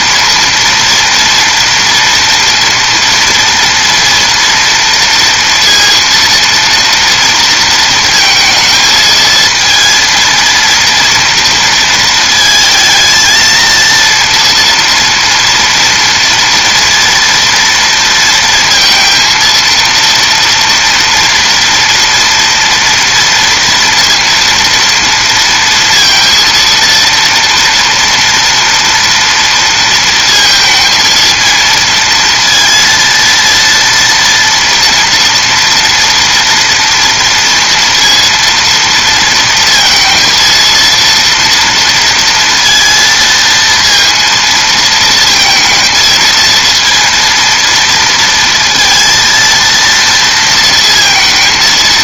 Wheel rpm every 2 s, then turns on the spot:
230, 230, 230, 230, 220, 230, 220, 230, 230, 230, 230, 230, 230, 230, 230, 220, 230, 230, 230, 230, 230, 230, 230, 230, 230, 230.
none